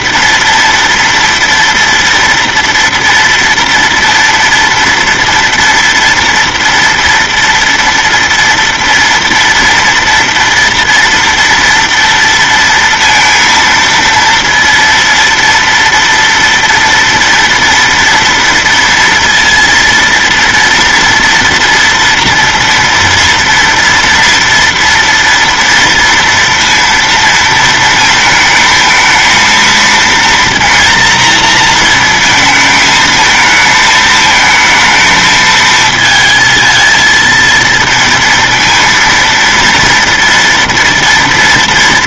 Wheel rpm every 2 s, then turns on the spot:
230, 230, 230, 230, 230, 230, 230, 230, 230, 230, 230, 240, 230, 230, 220, 230, 220, 220, 230, 230, 230.
none